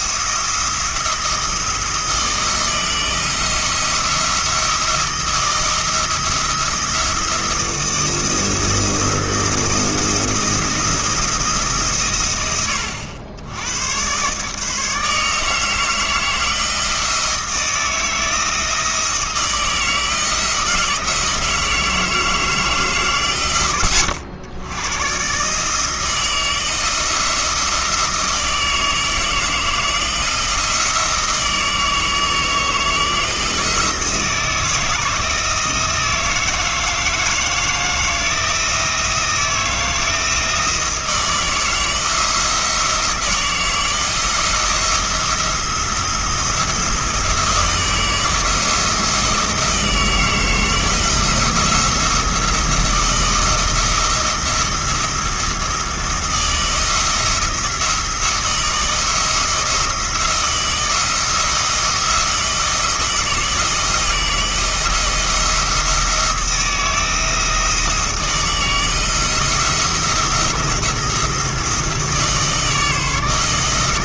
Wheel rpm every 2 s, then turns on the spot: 170, 160, 170, 170, 170, 170, 90, 150, 160, 160, 160, 150, 110, 160, 160, 160, 160, 160, 160, 160, 160, 160, 170, 170, 170, 170, 160, 170, 160, 160, 170, 160, 170, 170, 160, 170, 160.
none